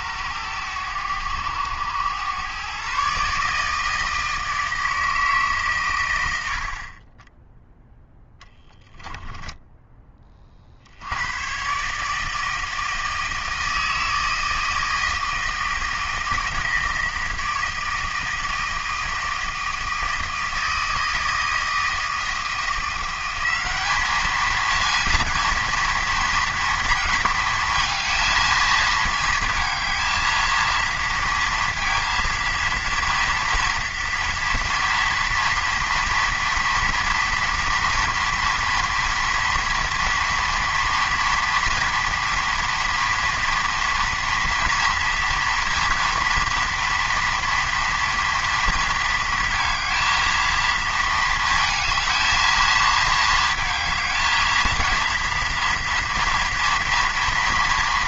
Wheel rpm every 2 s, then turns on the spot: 100, 130, 160, 60, 10, 50, 160, 160, 160, 160, 160, 170, 220, 230, 220, 230, 230, 230, 230, 230, 230, 230, 230, 230, 230, 220, 220, 230, 230.
none